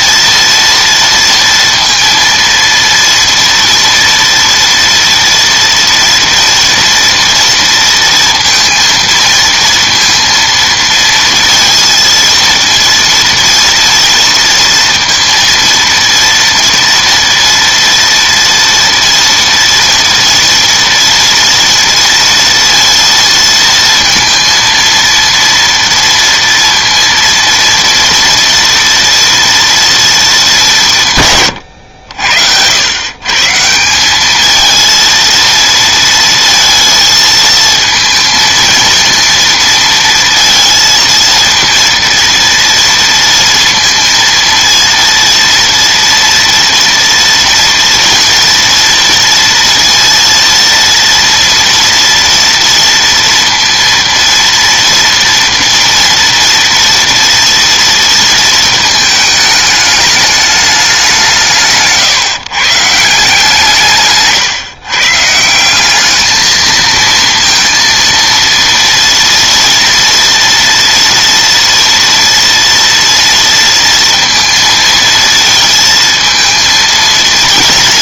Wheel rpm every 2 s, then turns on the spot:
230, 230, 230, 230, 230, 230, 230, 230, 230, 230, 230, 230, 230, 230, 230, 210, 80, 220, 220, 220, 230, 230, 230, 230, 240, 230, 230, 230, 230, 230, 210, 140, 130, 220, 230, 240, 230, 230, 230.
none